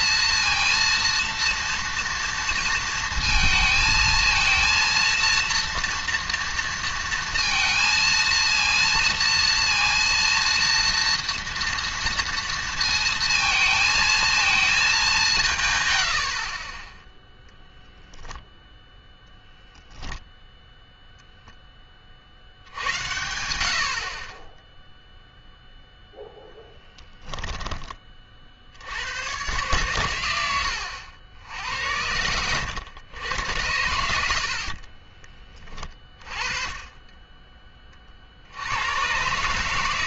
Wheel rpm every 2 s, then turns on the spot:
230, 230, 230, 230, 230, 230, 230, 220, 30, 0, 0, 80, 10, 10, 60, 90, 90, 60, 30, 80.
16-18